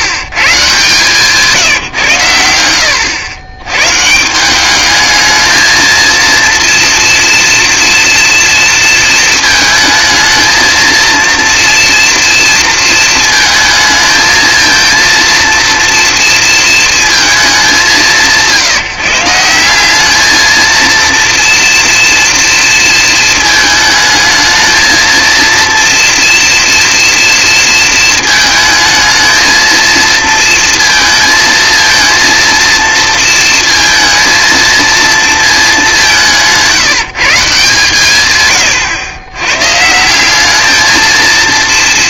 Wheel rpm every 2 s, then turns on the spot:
140, 90, 190, 240, 230, 230, 230, 230, 230, 160, 230, 230, 220, 230, 220, 230, 230, 230, 160, 110, 210.
none